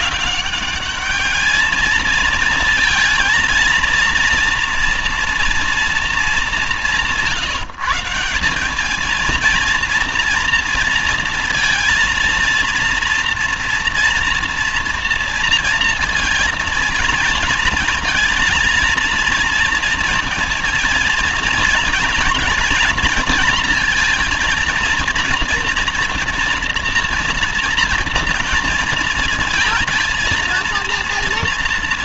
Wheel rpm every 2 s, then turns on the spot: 200, 220, 230, 180, 200, 230, 230, 230, 230, 220, 230, 230, 230, 230, 230, 230.
none